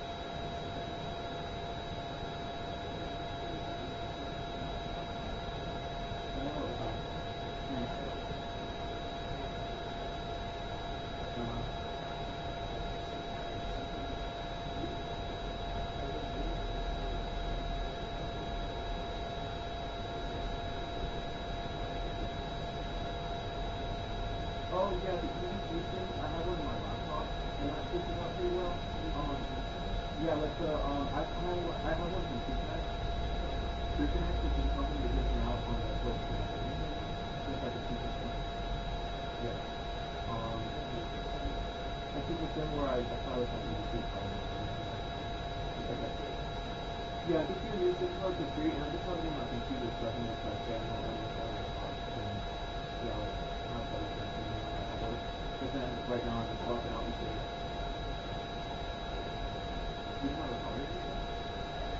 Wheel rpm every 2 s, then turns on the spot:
0, 0, 0, 0, 0, 0, 0, 0, 0, 0, 0, 0, 0, 0, 0, 0, 0, 0, 0, 0, 0, 0, 0, 0, 0, 0, 0, 0, 0, 0, 0.
none